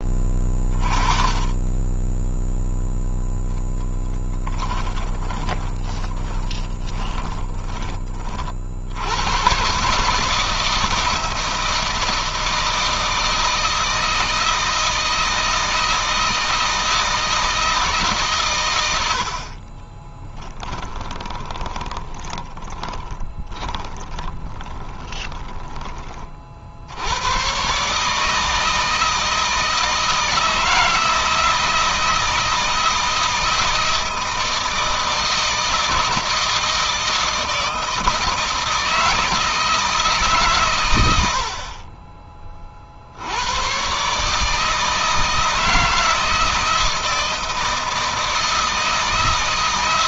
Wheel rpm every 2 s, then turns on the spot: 30, 0, 30, 20, 80, 160, 160, 160, 160, 90, 20, 20, 20, 80, 160, 160, 160, 160, 160, 160, 100, 60, 160, 160, 160.
4-8 20-26